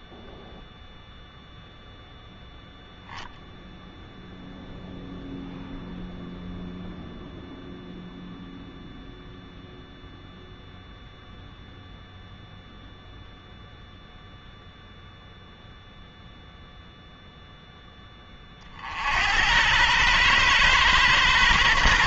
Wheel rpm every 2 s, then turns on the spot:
0, 0, 0, 0, 0, 0, 0, 0, 0, 50, 130.
none